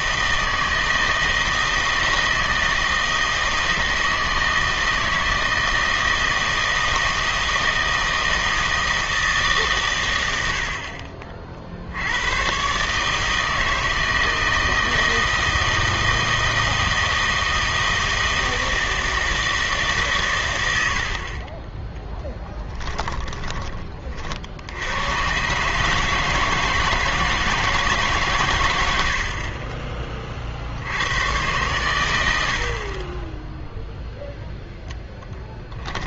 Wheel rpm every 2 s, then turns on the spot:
160, 160, 160, 160, 160, 60, 130, 160, 160, 160, 80, 10, 80, 160, 110, 70, 40, 0.
22-24